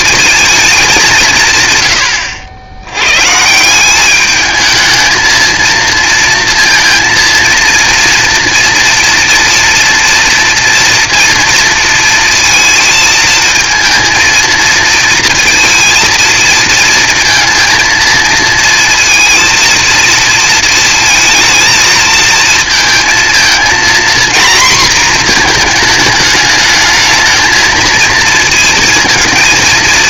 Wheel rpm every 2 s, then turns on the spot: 220, 90, 220, 230, 230, 230, 230, 230, 230, 230, 230, 230, 240, 220, 230.
none